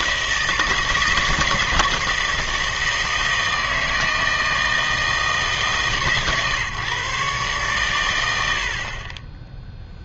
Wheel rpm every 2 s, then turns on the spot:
160, 160, 160, 140, 70.
none